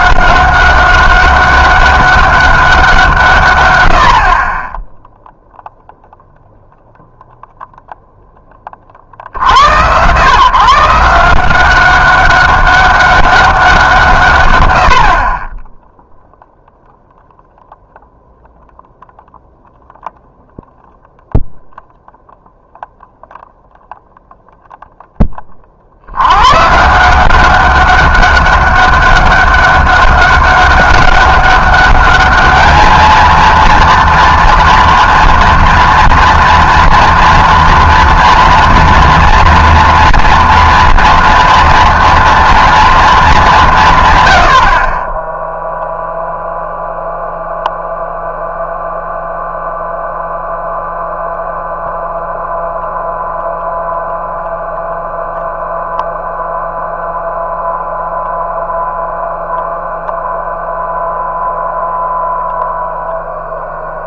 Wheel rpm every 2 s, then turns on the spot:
190, 190, 20, 0, 20, 140, 200, 90, 0, 0, 0, 0, 0, 130, 200, 200, 210, 240, 230, 230, 240, 230, 60, 0, 0, 0, 0, 0, 0, 0, 0, 0.
none